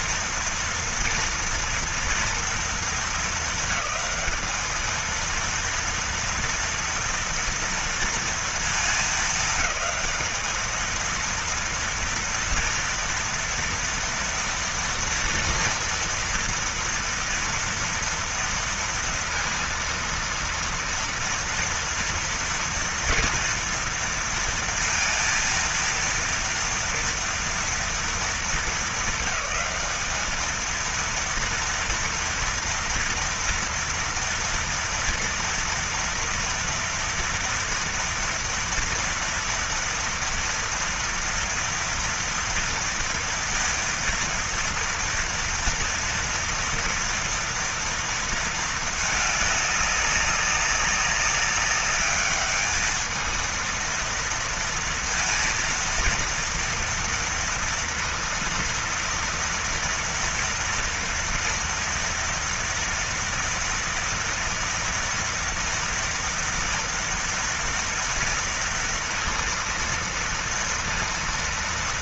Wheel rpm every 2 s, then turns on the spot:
230, 230, 220, 230, 230, 220, 230, 230, 230, 230, 230, 230, 230, 230, 210, 220, 230, 230, 230, 230, 230, 230, 230, 230, 220, 200, 210, 230, 230, 230, 230, 230, 230, 230, 230, 230.
none